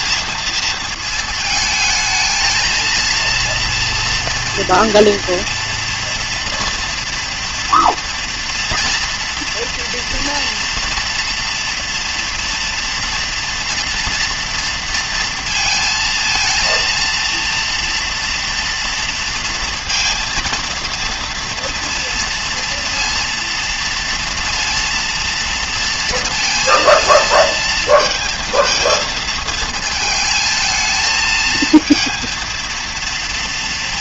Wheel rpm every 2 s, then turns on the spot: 220, 220, 230, 230, 230, 230, 230, 230, 230, 230, 230, 230, 230, 230, 220, 220, 230.
none